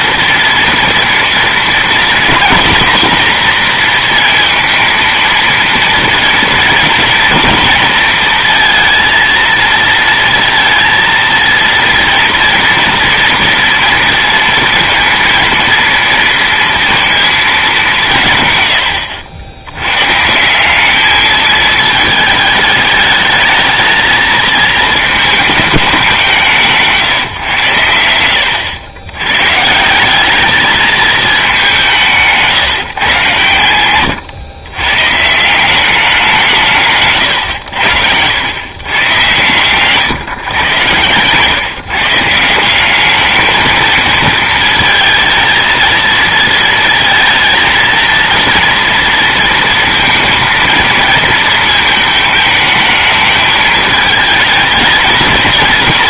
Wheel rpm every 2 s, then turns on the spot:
230, 240, 230, 230, 230, 230, 230, 230, 230, 100, 200, 210, 220, 160, 90, 210, 160, 130, 160, 120, 130, 180, 230, 230, 230, 220, 220, 220.
none